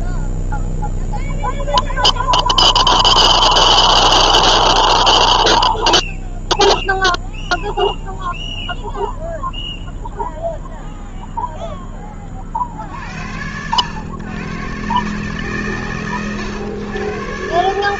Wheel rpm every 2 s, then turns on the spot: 0, 0, 0, 0, 0, 0, 60, 140, 120.
none